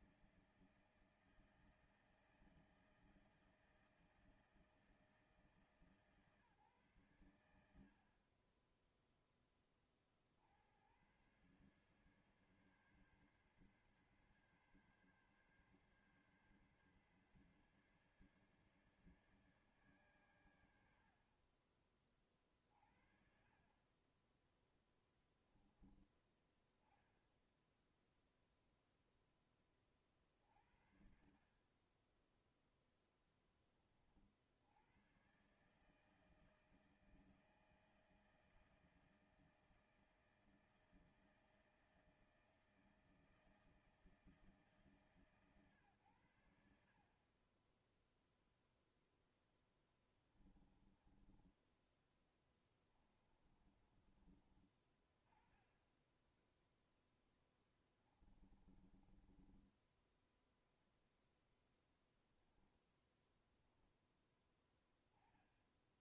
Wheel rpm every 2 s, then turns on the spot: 160, 160, 160, 140, 40, 60, 140, 140, 140, 140, 130, 40, 20, 10, 0, 40, 10, 50, 150, 160, 160, 160, 150, 90, 0, 10, 20, 30, 10, 20, 10, 10, 10.
22-26 32-34 50-54 56-60